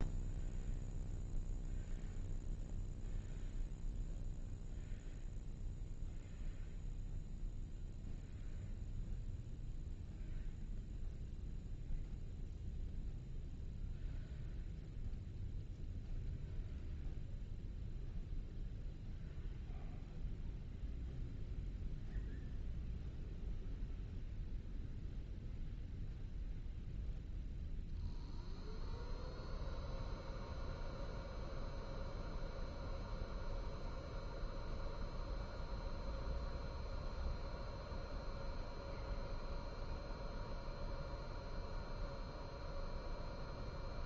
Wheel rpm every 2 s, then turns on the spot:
0, 0, 0, 0, 0, 0, 0, 0, 0, 0, 0, 0, 0, 0, 0, 0, 0, 0, 0, 0, 0, 0.
none